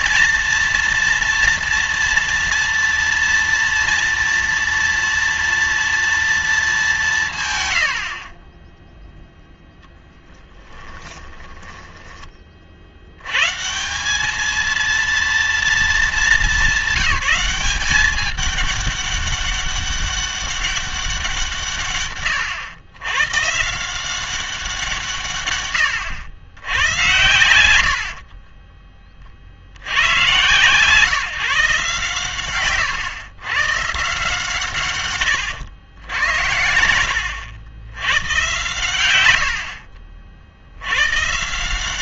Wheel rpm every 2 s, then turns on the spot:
230, 230, 230, 210, 10, 20, 50, 230, 200, 200, 200, 100, 180, 120, 30, 130, 120, 150, 80, 130, 70.
10-12 28-30 36-38